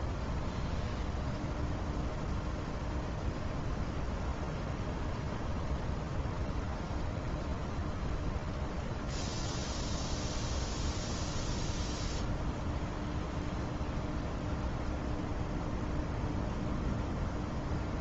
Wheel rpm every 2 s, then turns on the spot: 0, 0, 0, 0, 0, 0, 0, 0, 0.
none